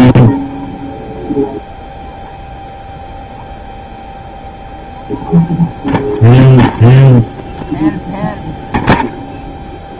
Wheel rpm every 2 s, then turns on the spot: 0, 0, 0, 0, 0.
none